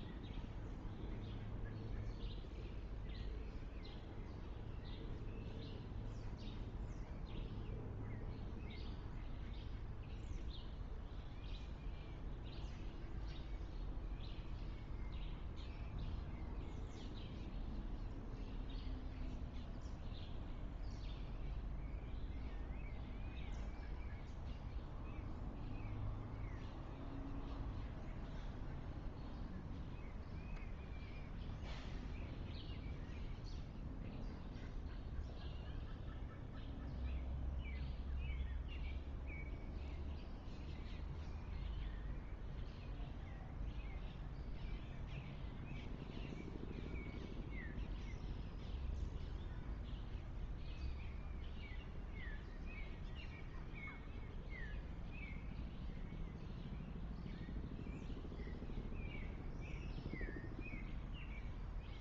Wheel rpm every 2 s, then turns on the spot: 0, 0, 0, 0, 0, 0, 0, 0, 0, 0, 0, 0, 0, 0, 0, 0, 0, 0, 0, 0, 0, 0, 0, 0, 0, 0, 0, 0, 0, 0, 0.
none